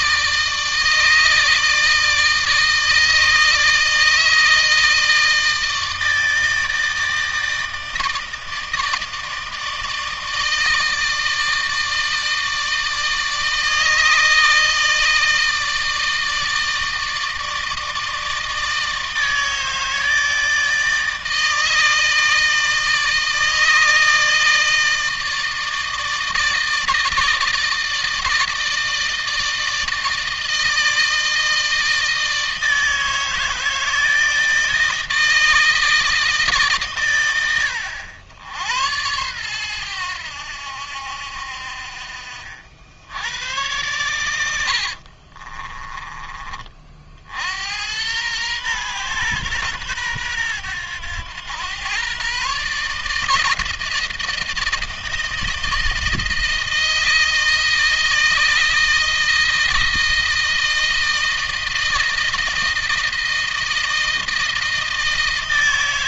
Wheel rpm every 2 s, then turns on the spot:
160, 160, 160, 160, 160, 160, 160, 160, 160, 160, 160, 160, 160, 160, 160, 160, 160, 160, 130, 100, 80, 70, 70, 40, 120, 100, 150, 160, 160, 160, 160, 160, 160.
44-46